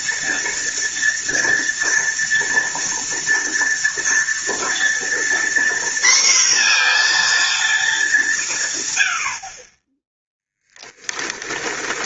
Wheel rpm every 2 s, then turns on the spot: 230, 230, 230, 240, 140, 10.
none